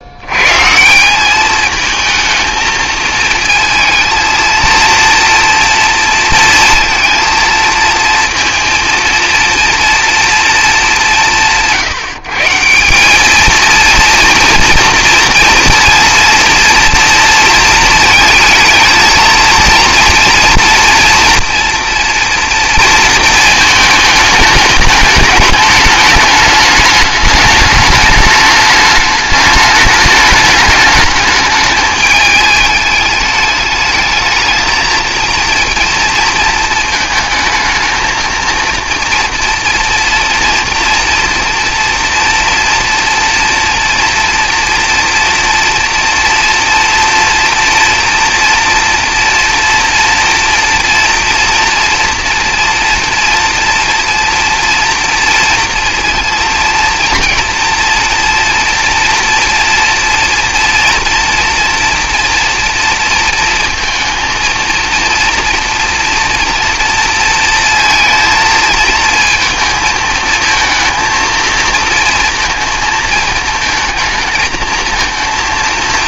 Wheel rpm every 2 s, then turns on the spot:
140, 220, 230, 230, 230, 210, 170, 230, 230, 220, 230, 230, 210, 210, 210, 210, 210, 220, 230, 220, 230, 240, 230, 230, 230, 230, 230, 230, 230, 240, 230, 230, 230, 230, 230, 230, 230, 220.
none